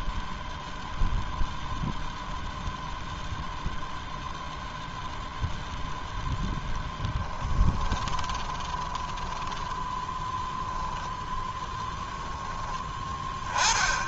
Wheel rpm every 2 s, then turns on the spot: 0, 0, 0, 10, 20, 0, 10.
6-10